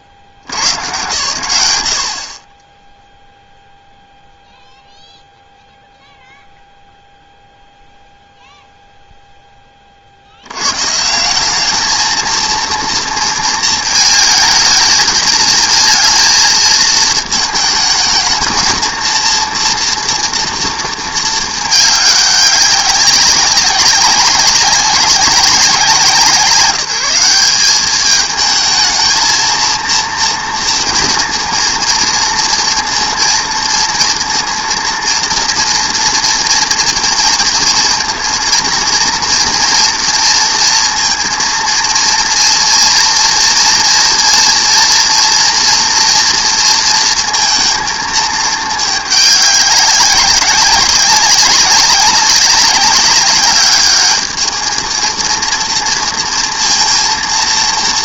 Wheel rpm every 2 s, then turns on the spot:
70, 20, 0, 0, 0, 110, 230, 220, 220, 220, 230, 200, 190, 170, 220, 230, 230, 230, 230, 230, 230, 230, 240, 230, 210, 190, 200, 220, 230.
none